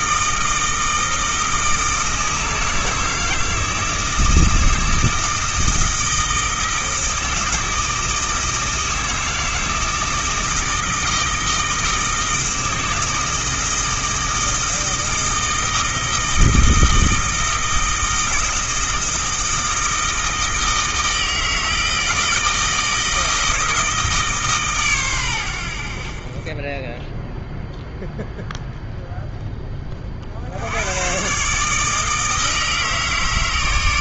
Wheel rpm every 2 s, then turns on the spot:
160, 160, 160, 160, 160, 160, 160, 160, 160, 160, 160, 160, 130, 10, 0, 100, 150.
none